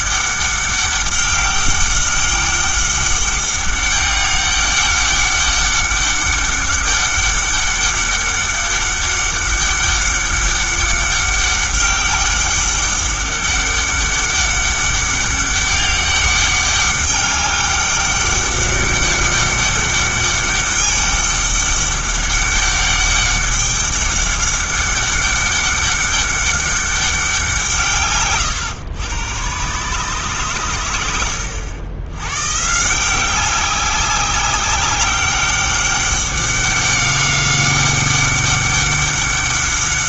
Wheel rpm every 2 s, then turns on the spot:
200, 200, 200, 200, 200, 200, 200, 200, 200, 200, 200, 200, 200, 200, 110, 110, 140, 190, 190, 200.
none